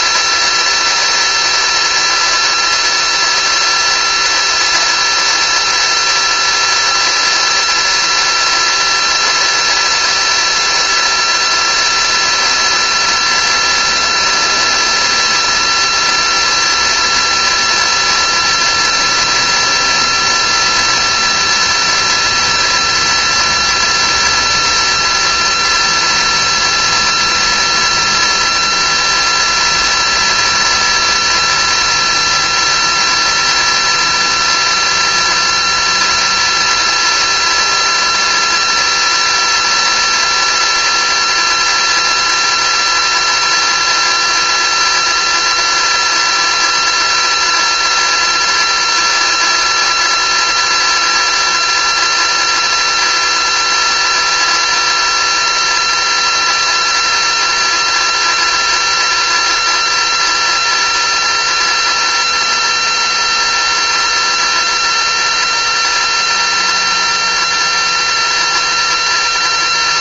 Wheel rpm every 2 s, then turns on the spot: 360, 350, 360, 360, 360, 350, 360, 360, 360, 360, 360, 360, 360, 360, 350, 360, 360, 360, 360, 360, 360, 360, 360, 360, 360, 360, 360, 360, 360, 360, 360, 360, 360, 360, 360.
none